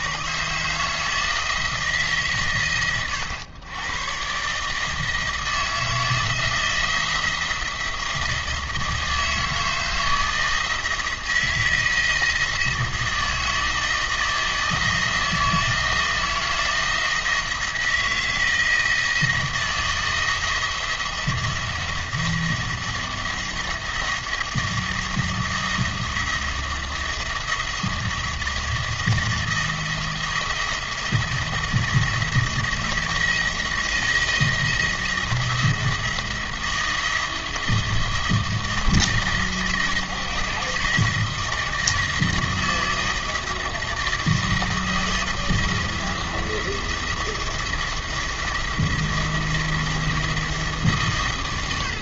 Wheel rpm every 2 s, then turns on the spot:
150, 120, 150, 170, 160, 160, 160, 160, 160, 160, 160, 170, 170, 170, 170, 170, 170, 160, 170, 160, 160, 160, 160, 170, 170, 150.
none